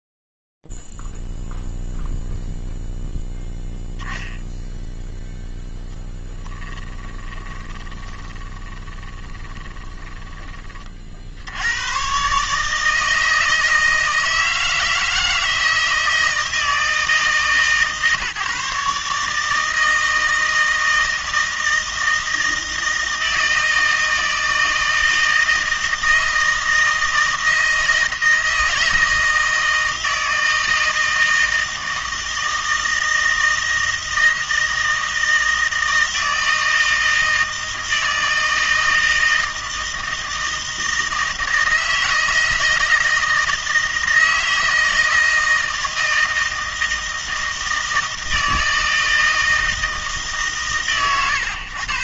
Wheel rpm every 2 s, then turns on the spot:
0, 0, 0, 10, 30, 10, 120, 160, 160, 150, 160, 160, 160, 160, 160, 160, 160, 160, 160, 160, 160, 160, 160, 160, 160, 120.
6-12